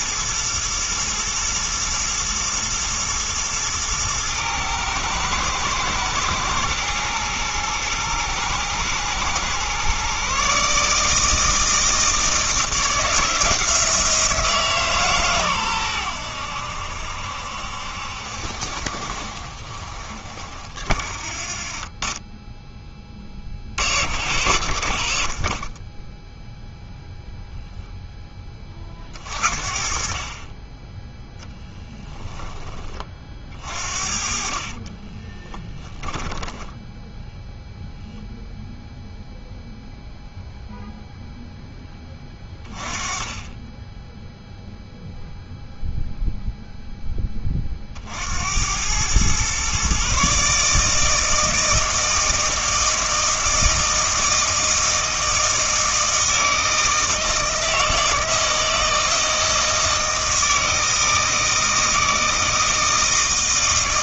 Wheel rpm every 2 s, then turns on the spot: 120, 110, 110, 110, 110, 150, 170, 160, 80, 60, 40, 10, 80, 0, 30, 10, 20, 40, 10, 0, 0, 20, 0, 0, 90, 150, 160, 160, 160, 160, 160, 160.
34-36